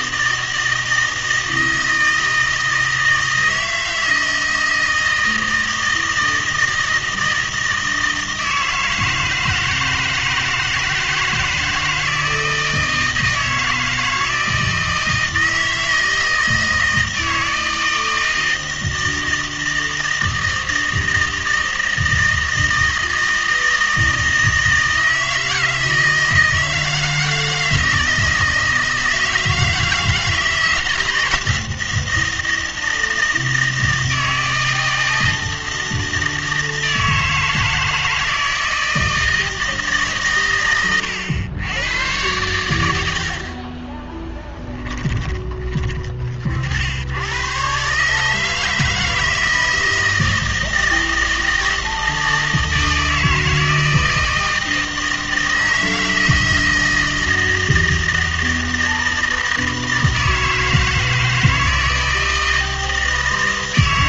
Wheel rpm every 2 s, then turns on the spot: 160, 160, 160, 160, 160, 160, 160, 160, 160, 160, 160, 160, 160, 160, 160, 160, 160, 160, 160, 160, 120, 100, 10, 60, 160, 160, 160, 160, 160, 160, 160, 160.
none